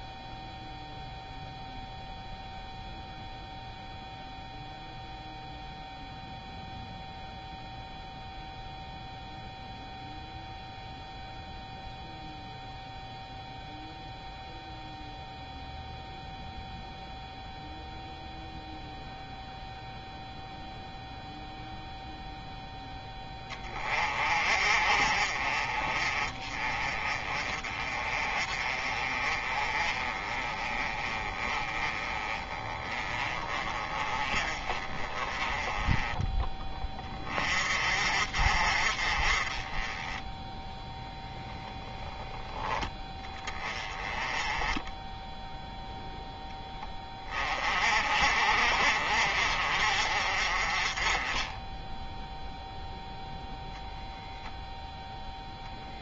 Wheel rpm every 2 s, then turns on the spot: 0, 0, 0, 0, 0, 0, 0, 0, 0, 0, 0, 10, 40, 30, 30, 20, 20, 30, 20, 40, 0, 20, 10, 10, 40, 30, 0, 0.
none